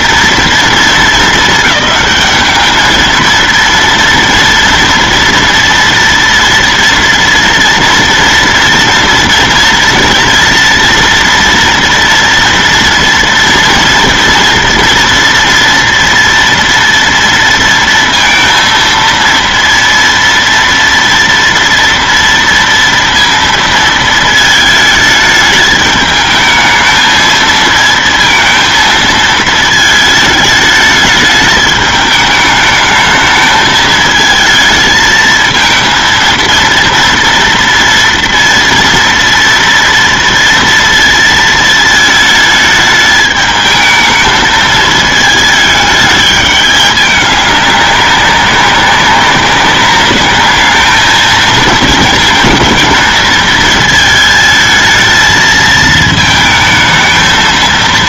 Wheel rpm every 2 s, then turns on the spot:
220, 210, 230, 230, 230, 230, 230, 230, 240, 230, 230, 240, 220, 220, 230, 210, 210, 220, 230, 240, 230, 220, 220, 210, 200, 210, 220, 220, 220.
none